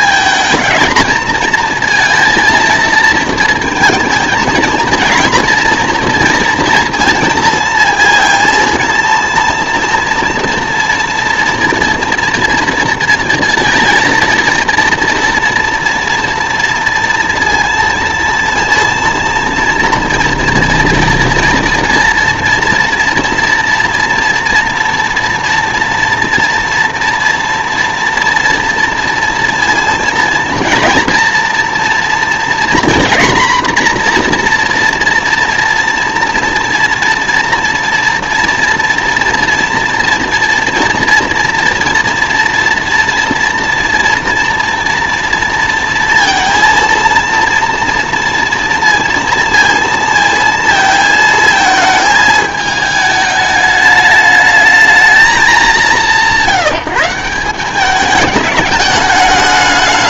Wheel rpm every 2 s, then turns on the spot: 220, 230, 230, 230, 230, 230, 240, 230, 230, 230, 230, 230, 230, 240, 230, 230, 240, 240, 230, 230, 230, 230, 230, 230, 230, 230, 210, 210, 180, 210.
none